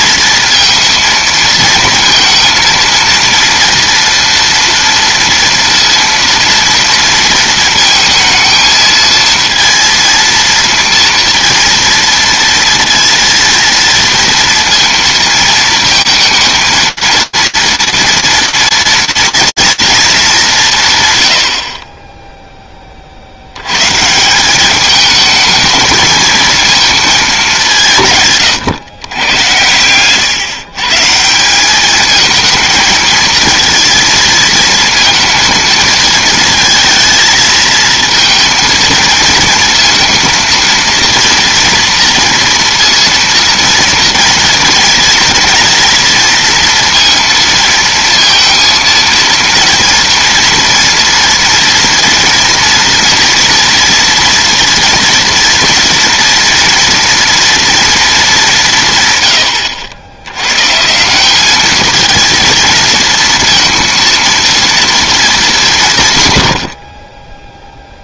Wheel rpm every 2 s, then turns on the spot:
230, 220, 230, 230, 230, 230, 230, 230, 230, 230, 170, 10, 200, 220, 130, 130, 220, 220, 220, 230, 230, 230, 230, 230, 230, 230, 230, 230, 230, 160, 140, 230, 240, 50.
none